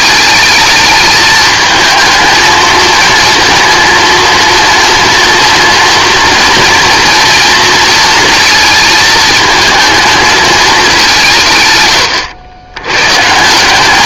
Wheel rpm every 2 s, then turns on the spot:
220, 220, 230, 230, 220, 210, 100.
none